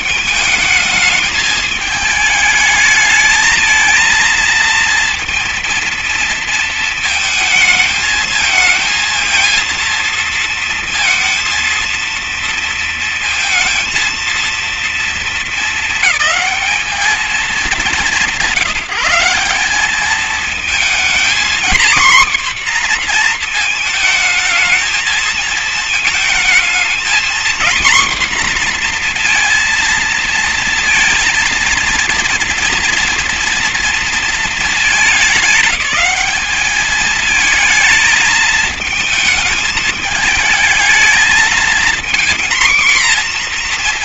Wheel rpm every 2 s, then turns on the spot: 220, 220, 230, 220, 230, 230, 230, 230, 210, 180, 240, 240, 220, 230, 240, 230, 230, 210, 220, 220, 220, 240.
none